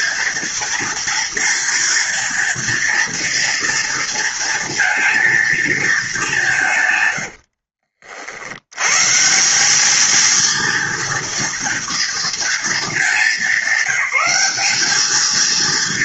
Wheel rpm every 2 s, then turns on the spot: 230, 230, 230, 100, 150, 230, 210, 220.
6-8